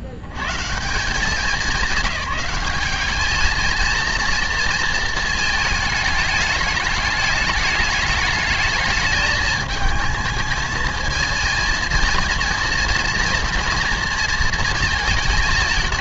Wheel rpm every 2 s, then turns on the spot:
140, 200, 230, 210, 210, 220, 230, 230.
none